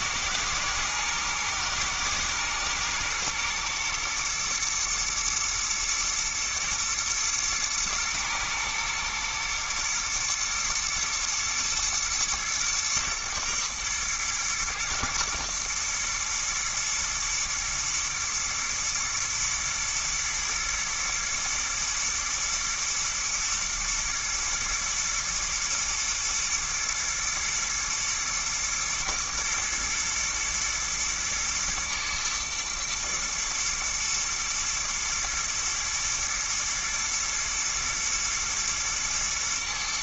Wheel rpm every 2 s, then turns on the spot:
120, 120, 120, 120, 110, 120, 110, 120, 110, 120, 120, 120, 110, 110, 110, 110, 110, 120, 120, 120.
none